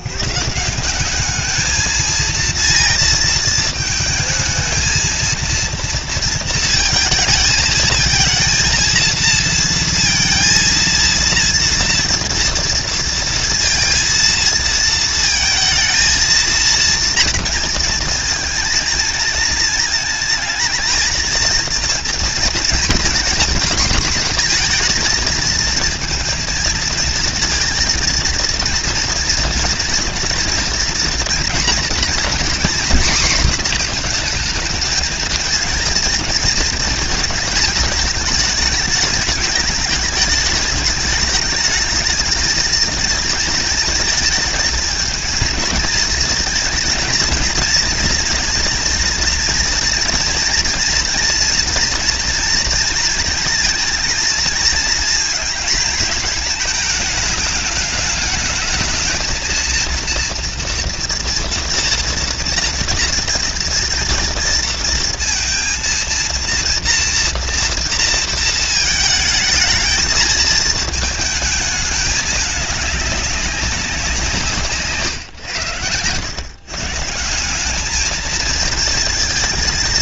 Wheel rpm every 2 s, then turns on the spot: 160, 230, 220, 230, 230, 230, 230, 230, 230, 230, 220, 220, 230, 230, 230, 230, 250, 230, 230, 220, 220, 220, 230, 230, 230, 230, 230, 230, 220, 220, 230, 240, 230, 230, 220, 220, 210, 160, 130, 230.
none